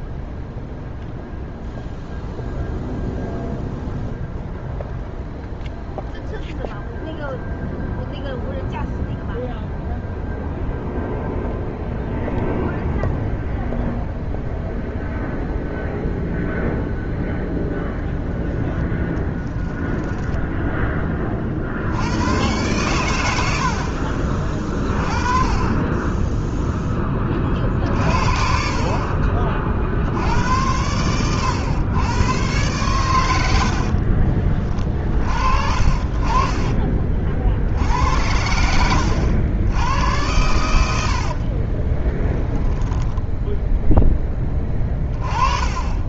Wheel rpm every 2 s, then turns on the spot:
0, 0, 0, 0, 0, 0, 0, 0, 0, 10, 10, 110, 30, 10, 50, 100, 110, 40, 30, 90, 80, 10, 20.
38-42